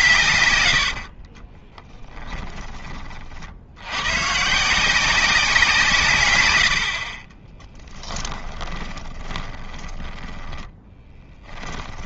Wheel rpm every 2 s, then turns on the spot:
90, 20, 170, 80, 20, 10.
0-2 8-12